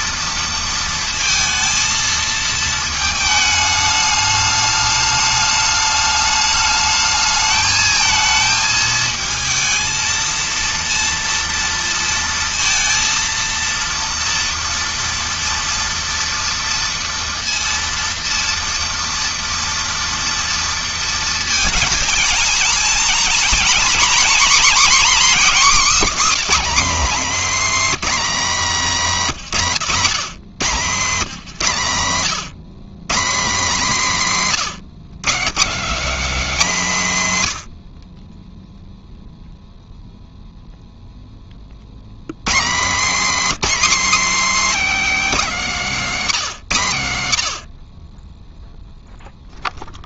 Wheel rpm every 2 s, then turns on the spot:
230, 220, 210, 210, 220, 230, 230, 230, 230, 230, 230, 230, 260, 260, 210, 150, 150, 170, 210, 0, 0, 170, 280, 150, 0.
42-46